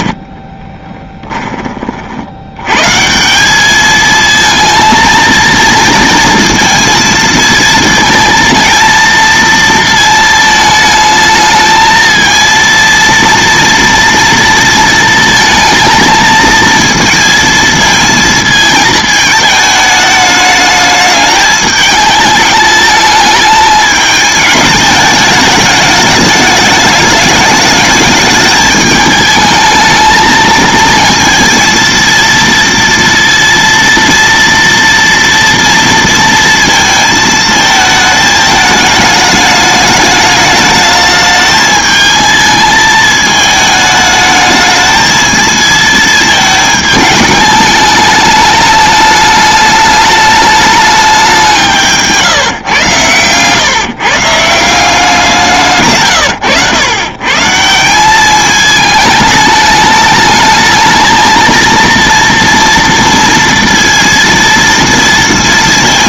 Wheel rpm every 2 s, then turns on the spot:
30, 120, 230, 230, 230, 220, 230, 230, 230, 220, 210, 210, 210, 210, 220, 230, 230, 230, 230, 210, 210, 220, 220, 220, 210, 210, 130, 170, 120, 220, 220, 230, 230.
0-2